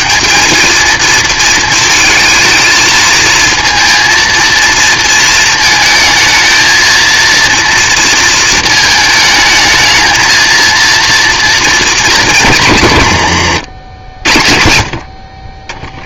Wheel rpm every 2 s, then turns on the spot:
220, 220, 230, 230, 230, 230, 150, 60.
none